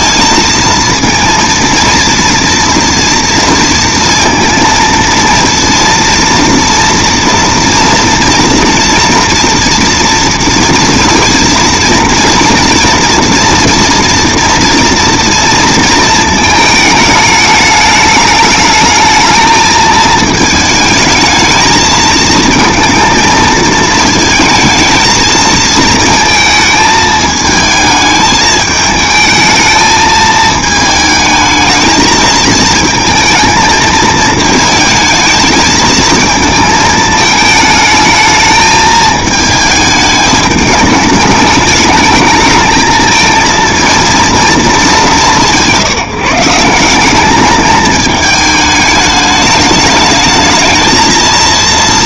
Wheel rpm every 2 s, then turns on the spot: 230, 230, 230, 230, 230, 230, 230, 230, 220, 210, 220, 230, 230, 220, 220, 220, 220, 220, 220, 220, 210, 210, 220, 170, 210, 220.
none